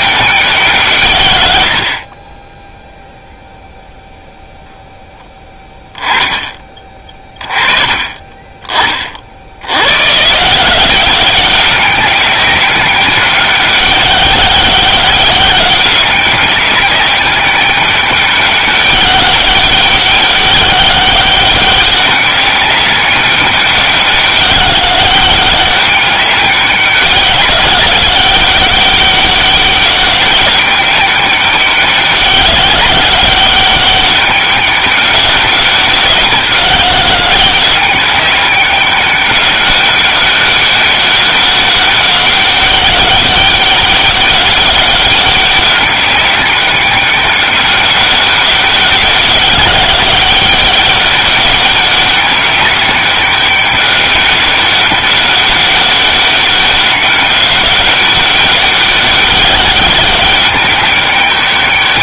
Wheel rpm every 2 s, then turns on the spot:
170, 10, 0, 20, 30, 170, 200, 190, 190, 200, 190, 200, 190, 190, 190, 200, 190, 200, 190, 200, 200, 200, 200, 200, 200, 200, 200, 200, 200, 200, 200.
none